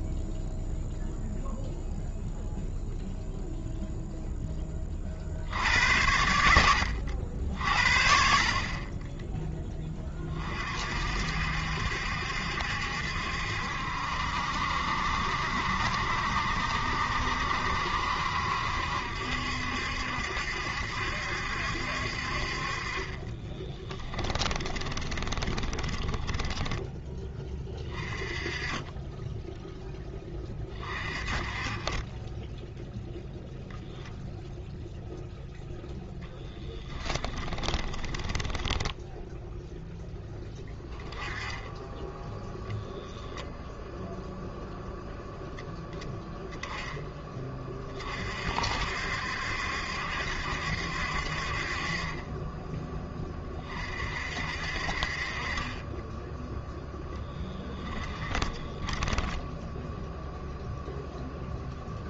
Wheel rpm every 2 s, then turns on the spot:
0, 0, 10, 80, 20, 50, 70, 70, 70, 70, 70, 30, 20, 10, 20, 30, 0, 0, 10, 10, 10, 0, 0, 10, 60, 60, 10, 50, 0, 10, 0.
24-26 36-40 58-60